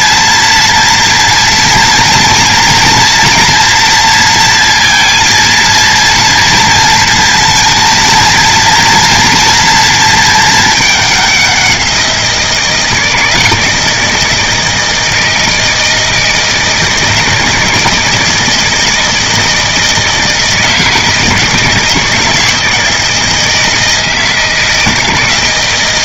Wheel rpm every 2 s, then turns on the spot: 230, 230, 230, 230, 230, 210, 160, 160, 160, 160, 160, 160, 160.
none